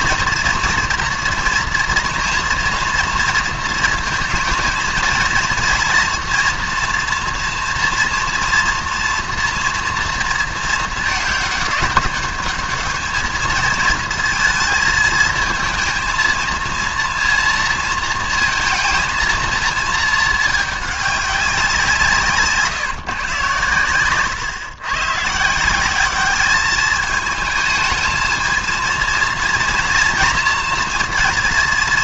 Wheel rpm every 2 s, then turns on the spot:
230, 230, 230, 230, 240, 220, 210, 230, 230, 230, 210, 150, 120, 210, 230, 230.
none